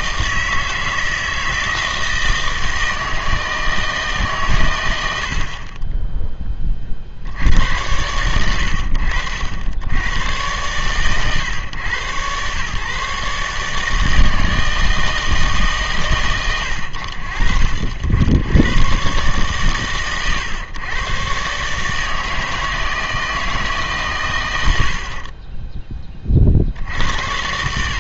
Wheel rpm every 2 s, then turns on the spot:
160, 160, 110, 30, 90, 120, 120, 160, 110, 100, 120, 160, 90, 60.
none